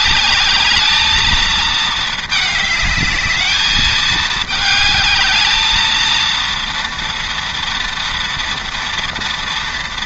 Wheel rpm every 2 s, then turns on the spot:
220, 210, 210, 230, 230.
none